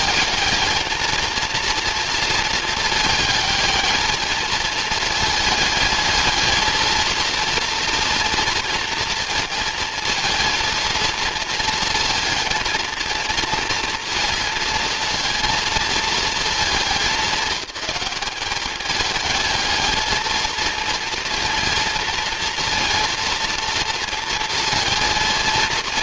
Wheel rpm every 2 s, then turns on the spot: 220, 220, 220, 220, 230, 230, 230, 220, 200, 200, 230, 230, 230.
none